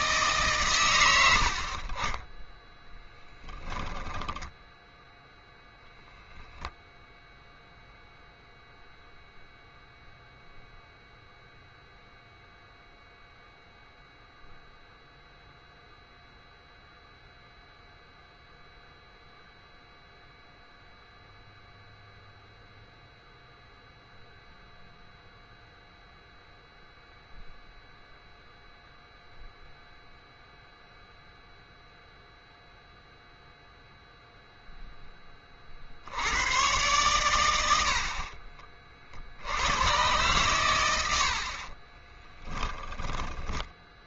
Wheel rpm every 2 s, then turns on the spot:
110, 0, 0, 0, 0, 0, 0, 0, 0, 0, 0, 0, 0, 0, 0, 0, 0, 0, 100, 50, 110, 10.
42-44